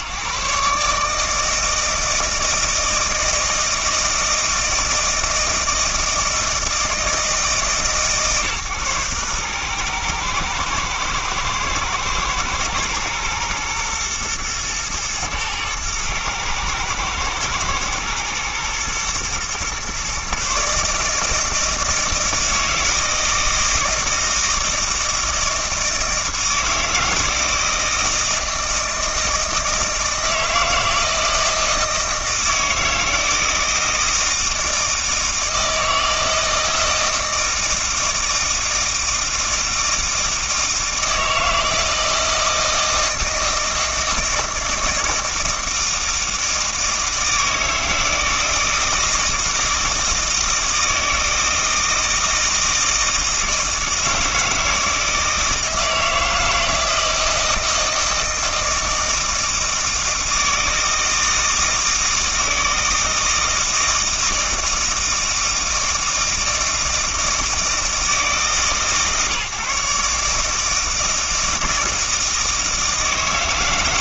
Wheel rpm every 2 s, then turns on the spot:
140, 160, 160, 160, 130, 110, 120, 120, 110, 110, 150, 160, 160, 160, 160, 160, 160, 160, 160, 160, 160, 160, 160, 160, 160, 160, 160, 160, 160, 160, 160, 160, 160, 160, 140, 160, 160.
none